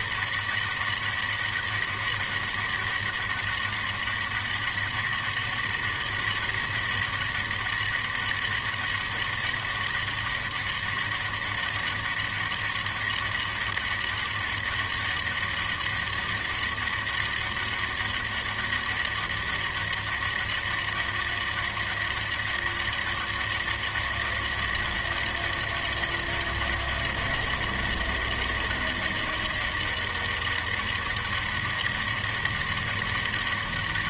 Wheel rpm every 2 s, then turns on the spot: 200, 200, 200, 200, 200, 200, 200, 200, 200, 200, 200, 200, 200, 200, 200, 200, 200.
none